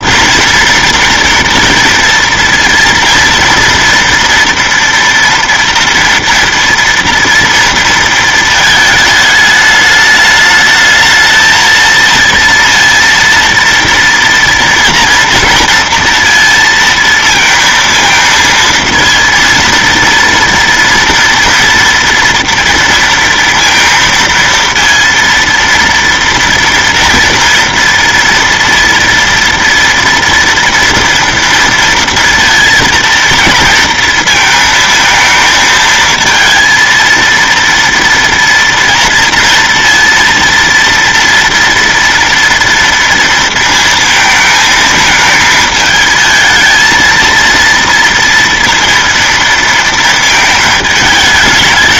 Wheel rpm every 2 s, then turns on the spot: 230, 230, 240, 230, 220, 210, 230, 230, 230, 230, 230, 230, 230, 230, 230, 230, 230, 220, 220, 230, 230, 240, 220, 220, 230, 220.
none